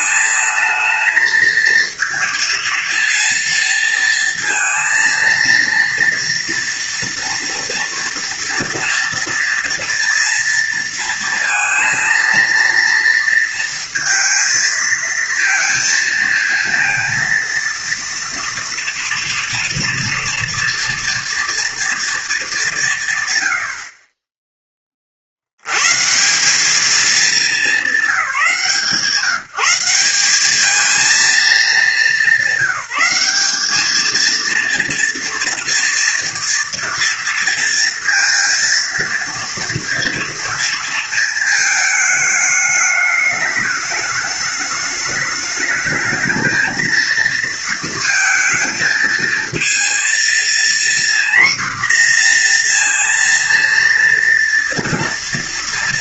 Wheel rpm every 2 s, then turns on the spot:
220, 230, 230, 230, 230, 230, 230, 230, 230, 230, 230, 160, 30, 200, 170, 220, 190, 230, 230, 230, 230, 210, 210, 230, 230, 240, 230, 230.
none